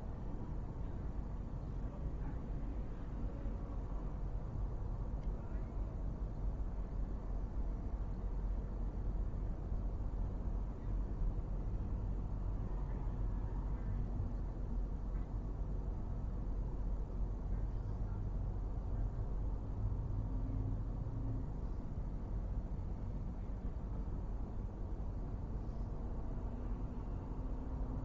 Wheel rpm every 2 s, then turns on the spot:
0, 0, 0, 0, 0, 0, 0, 0, 0, 0, 0, 0, 0, 0.
none